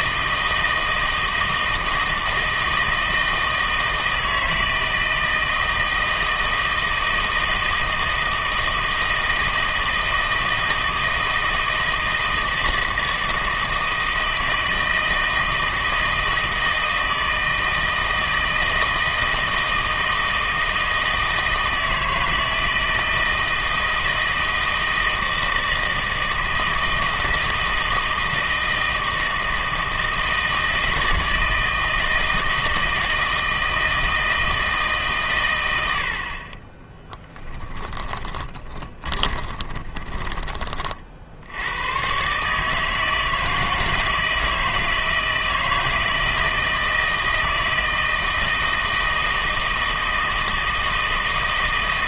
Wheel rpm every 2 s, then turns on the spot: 160, 160, 160, 160, 160, 160, 160, 160, 160, 160, 160, 160, 160, 160, 160, 160, 160, 160, 20, 20, 30, 150, 160, 160, 160, 160.
36-40